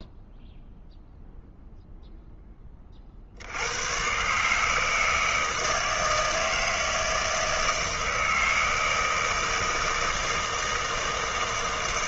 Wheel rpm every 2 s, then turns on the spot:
0, 20, 150, 160, 160, 160.
none